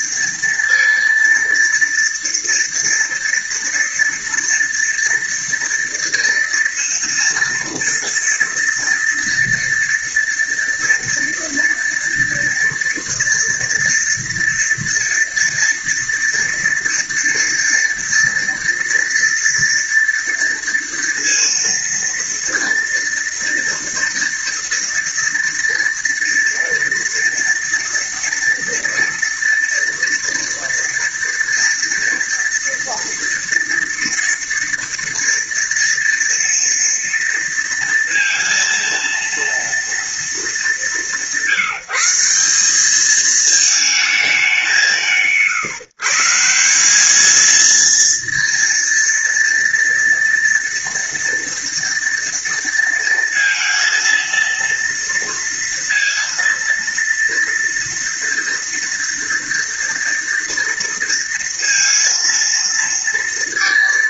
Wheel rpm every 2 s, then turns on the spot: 230, 230, 230, 230, 230, 230, 230, 230, 230, 230, 230, 230, 230, 240, 230, 230, 230, 230, 230, 230, 190, 200, 190, 180, 230, 230, 230, 230, 230, 230, 230, 230.
none